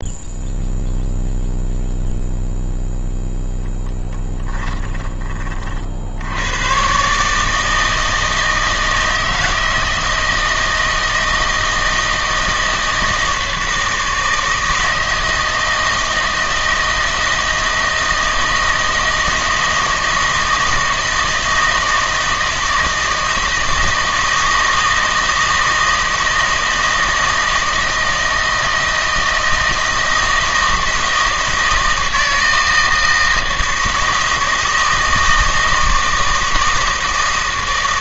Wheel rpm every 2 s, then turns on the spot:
0, 0, 20, 100, 160, 160, 160, 160, 160, 160, 160, 160, 160, 160, 160, 160, 160, 160, 160.
4-6